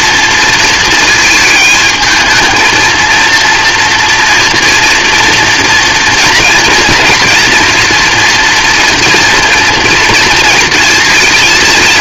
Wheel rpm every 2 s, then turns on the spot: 220, 230, 240, 230, 230, 230.
none